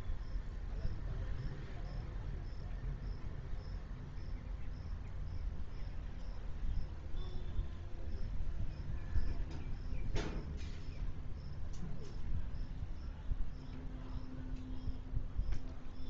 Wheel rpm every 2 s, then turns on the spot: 0, 0, 0, 0, 0, 0, 0, 0.
none